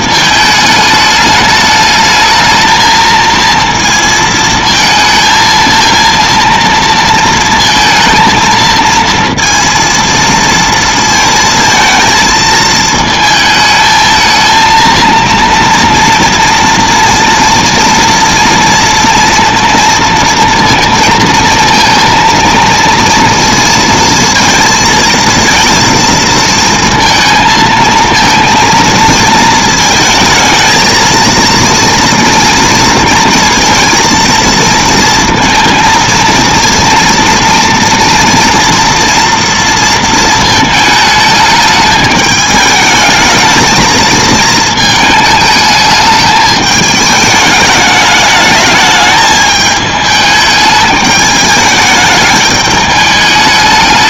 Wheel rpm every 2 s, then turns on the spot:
210, 220, 230, 230, 230, 230, 220, 230, 230, 230, 230, 230, 230, 220, 230, 230, 230, 230, 230, 230, 220, 210, 220, 210, 210, 210, 210.
none